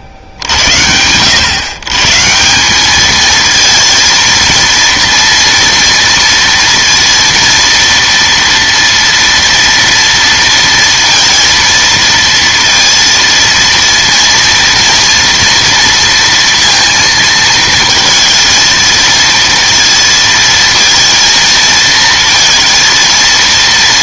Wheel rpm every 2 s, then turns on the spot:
70, 180, 230, 230, 230, 230, 230, 230, 230, 230, 230, 230.
none